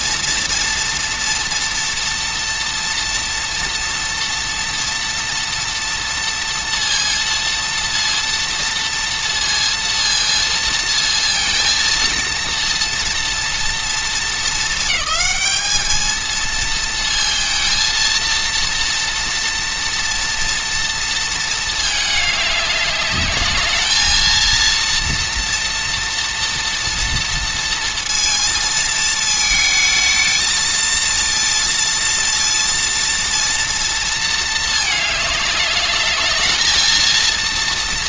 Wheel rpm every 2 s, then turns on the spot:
230, 240, 230, 230, 230, 230, 230, 220, 230, 230, 230, 210, 230, 230, 220, 230, 230, 210, 230.
none